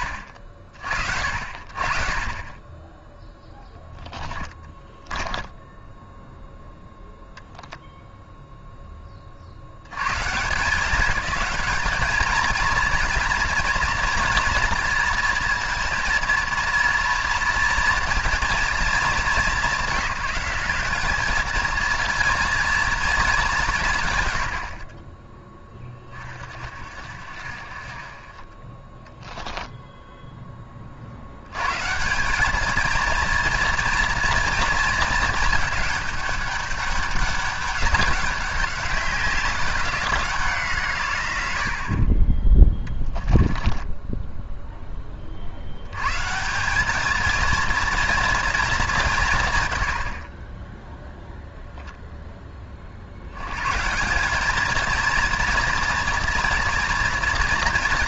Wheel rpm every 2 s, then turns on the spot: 50, 20, 10, 0, 30, 190, 230, 230, 230, 210, 200, 220, 30, 50, 20, 40, 220, 220, 200, 200, 150, 10, 10, 200, 200, 0, 60, 230, 230.
42-44